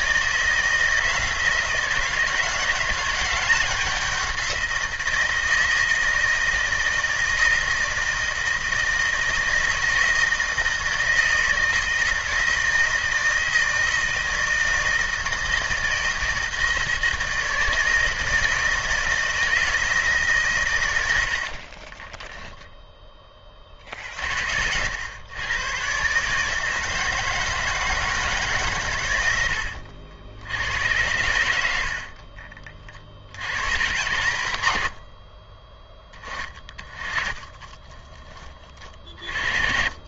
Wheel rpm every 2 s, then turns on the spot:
170, 180, 180, 160, 160, 160, 160, 160, 160, 160, 120, 0, 70, 160, 140, 90, 40, 80, 20, 20.
none